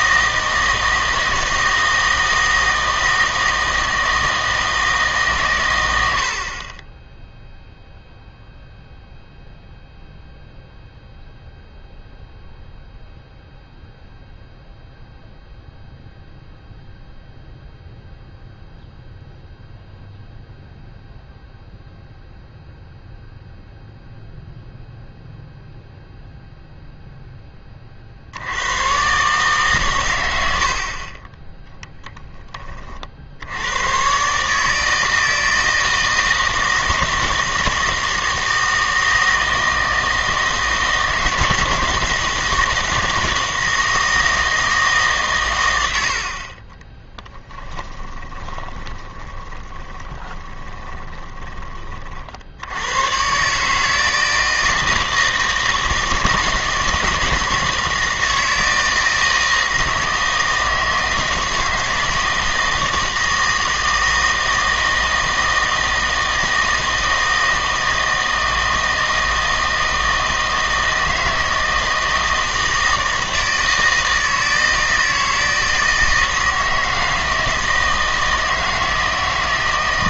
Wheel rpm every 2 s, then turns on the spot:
160, 160, 160, 30, 0, 0, 0, 0, 0, 0, 0, 0, 0, 0, 90, 70, 30, 150, 160, 160, 160, 160, 160, 30, 20, 30, 90, 160, 160, 160, 160, 160, 160, 160, 160, 160, 160, 160, 160, 160.
46-52